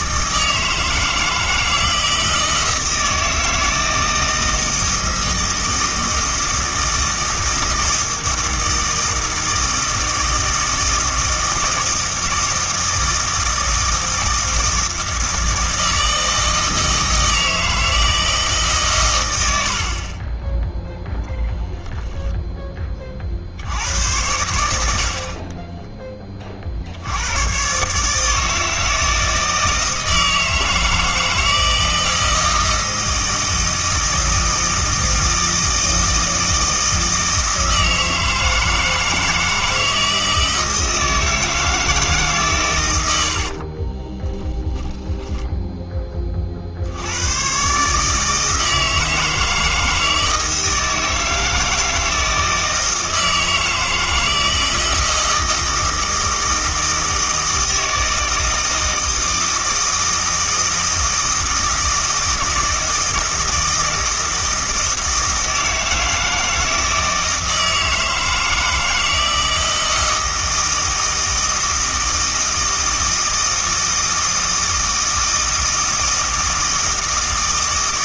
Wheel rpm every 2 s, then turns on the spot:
160, 160, 160, 160, 160, 160, 160, 160, 160, 140, 0, 20, 70, 50, 160, 160, 160, 160, 160, 160, 160, 110, 10, 60, 160, 160, 160, 160, 160, 160, 160, 160, 160, 160, 160, 160, 160, 160, 160.
none